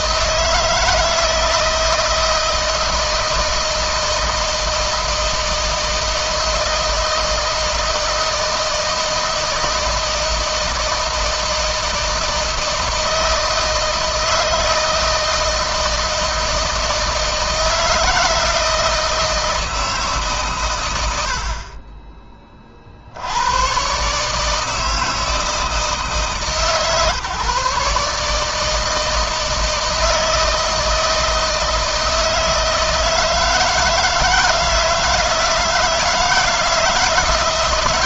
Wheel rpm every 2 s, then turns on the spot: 160, 160, 160, 160, 160, 160, 160, 160, 160, 160, 120, 40, 160, 150, 160, 160, 160, 160, 160.
none